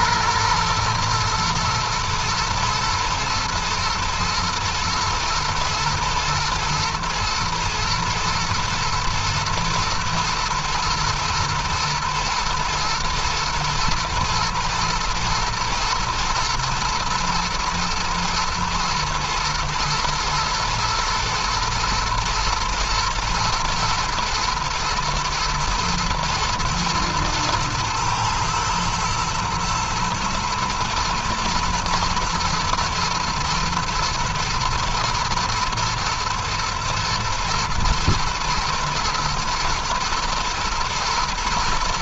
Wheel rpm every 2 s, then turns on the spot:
120, 120, 120, 110, 110, 110, 110, 110, 110, 110, 110, 110, 110, 120, 110, 110, 110, 120, 120, 110, 110.
none